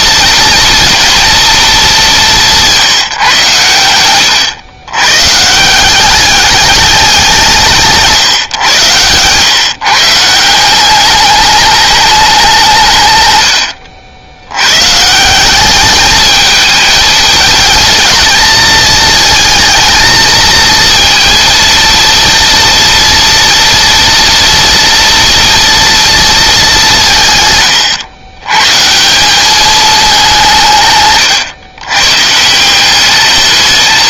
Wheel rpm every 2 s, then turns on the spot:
240, 160, 120, 200, 120, 200, 130, 160, 220, 220, 230, 230, 240, 170, 170, 150, 200.
30-32